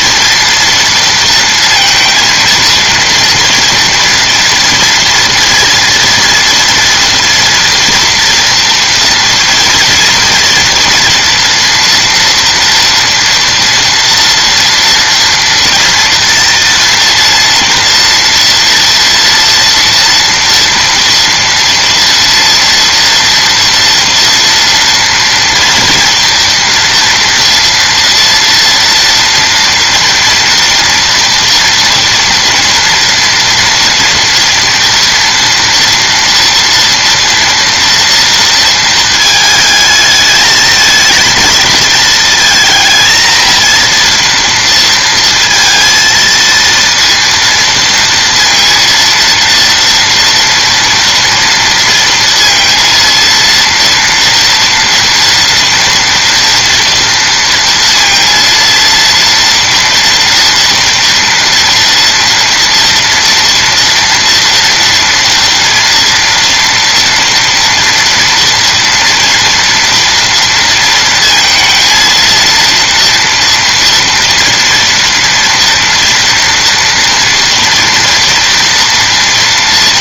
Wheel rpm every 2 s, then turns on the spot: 230, 230, 240, 230, 240, 230, 230, 230, 230, 230, 230, 240, 230, 230, 230, 230, 230, 230, 230, 230, 220, 230, 230, 230, 230, 230, 230, 230, 230, 230, 230, 230, 230, 230, 240, 230, 230, 230, 230, 230.
none